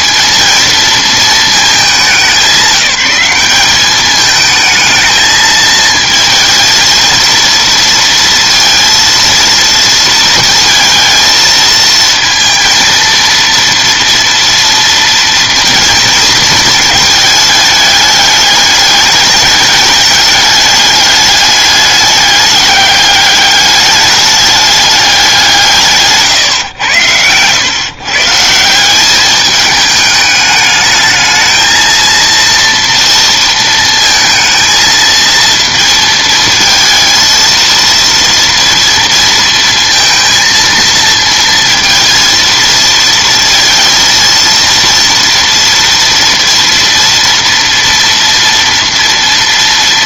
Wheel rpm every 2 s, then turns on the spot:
230, 180, 220, 220, 230, 230, 230, 230, 230, 210, 210, 200, 210, 120, 170, 210, 230, 230, 230, 230, 230, 230, 230, 230, 230.
none